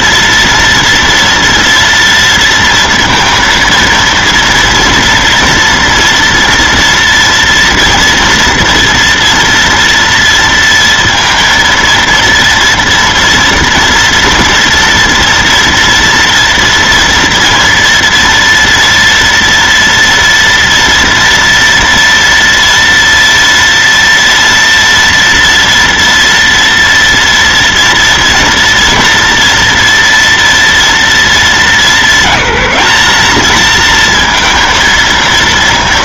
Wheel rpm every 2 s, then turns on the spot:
230, 230, 230, 230, 230, 230, 230, 230, 230, 230, 230, 230, 230, 230, 230, 230, 210, 230.
none